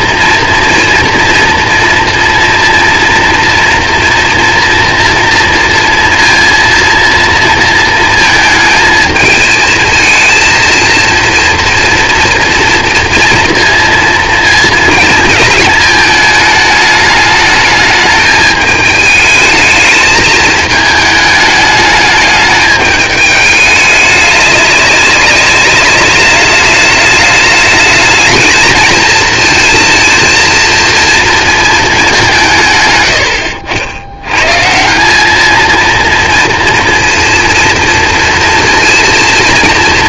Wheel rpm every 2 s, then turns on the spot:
240, 230, 230, 230, 220, 230, 230, 230, 210, 210, 220, 210, 200, 200, 220, 230, 180, 130, 230, 230.
none